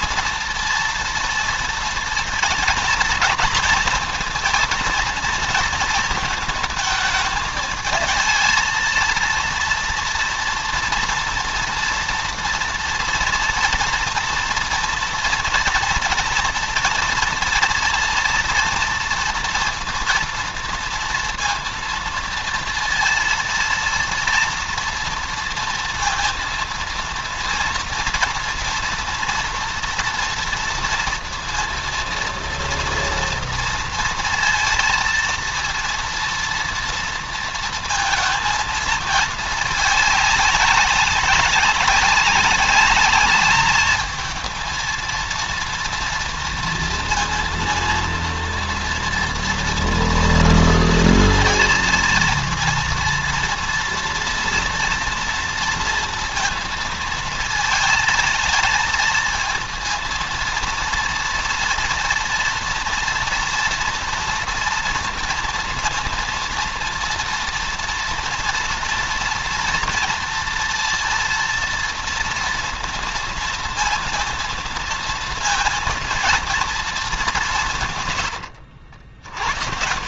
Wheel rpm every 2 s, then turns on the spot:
230, 230, 230, 220, 220, 230, 230, 240, 230, 230, 230, 230, 230, 230, 240, 230, 230, 230, 230, 220, 200, 200, 220, 230, 230, 230, 230, 230, 230, 230, 230, 230, 230, 230, 230, 230, 230, 230, 220, 90.
none